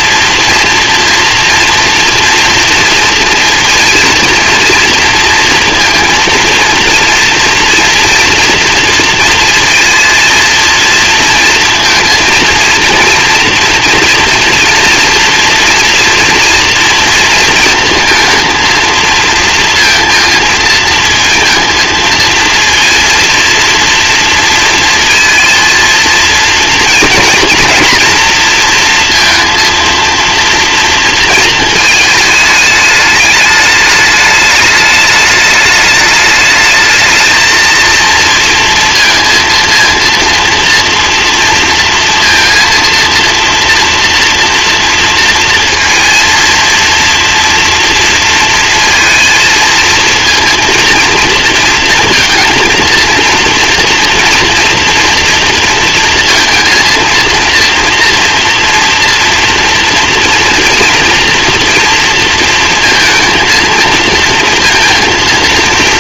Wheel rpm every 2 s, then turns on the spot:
230, 240, 240, 230, 230, 230, 230, 230, 230, 230, 230, 230, 230, 230, 230, 230, 210, 210, 210, 230, 230, 230, 230, 230, 230, 230, 230, 230, 230, 230, 230, 230, 230.
none